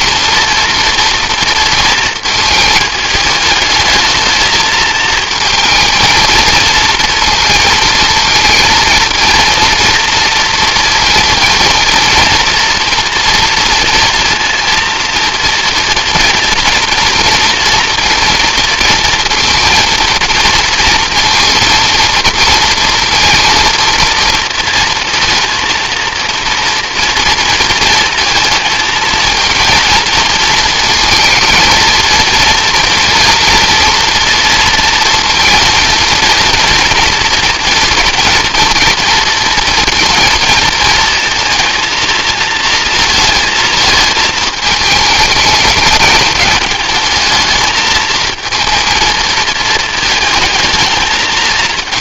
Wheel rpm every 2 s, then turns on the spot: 230, 220, 220, 230, 230, 230, 230, 230, 230, 230, 220, 230, 230, 230, 230, 230, 240, 230, 230, 230, 230, 220, 220, 220, 220, 220.
none